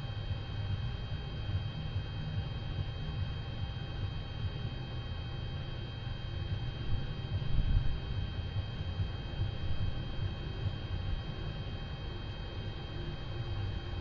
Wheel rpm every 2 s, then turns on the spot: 0, 0, 0, 0, 0, 0, 0.
none